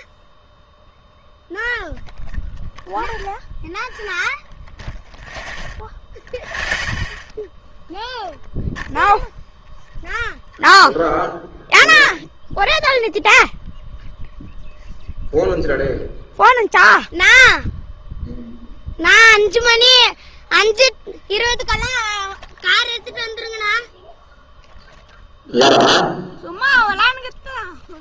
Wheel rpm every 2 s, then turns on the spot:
0, 0, 0, 0, 0, 0, 0, 0, 0, 0, 0, 0, 0, 0.
none